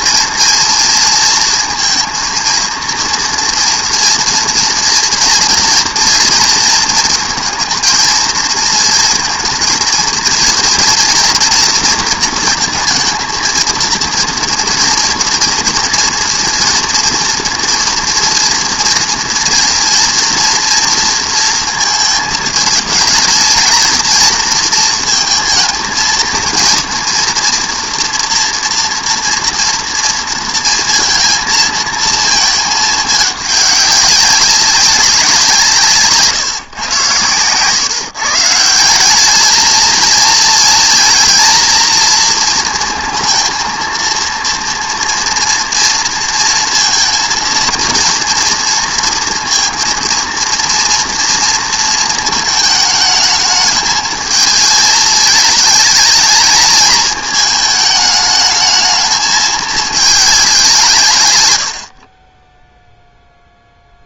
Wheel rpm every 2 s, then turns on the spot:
230, 230, 230, 220, 220, 230, 230, 230, 230, 230, 230, 220, 230, 230, 230, 230, 220, 190, 130, 170, 220, 230, 240, 230, 230, 230, 220, 220, 210, 220, 190, 10.
none